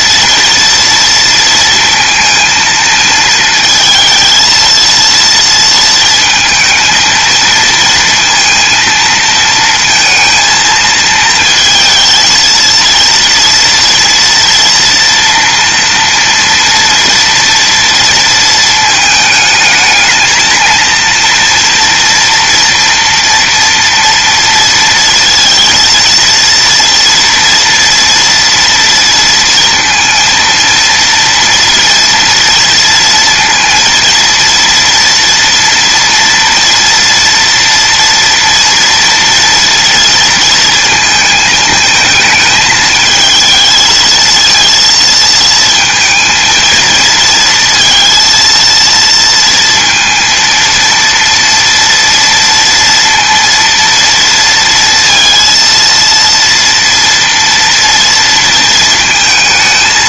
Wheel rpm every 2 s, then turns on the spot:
230, 230, 230, 220, 230, 220, 230, 230, 230, 220, 230, 230, 230, 230, 230, 230, 230, 230, 230, 230, 220, 220, 230, 220, 230, 230, 230, 230, 230, 230.
none